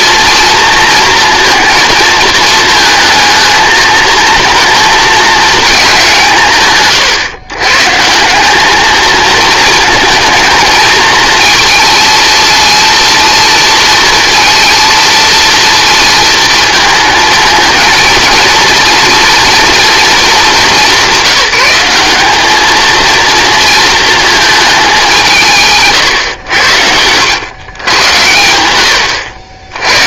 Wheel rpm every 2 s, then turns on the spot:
230, 220, 220, 140, 210, 230, 230, 230, 220, 230, 200, 220, 210, 80, 90.
none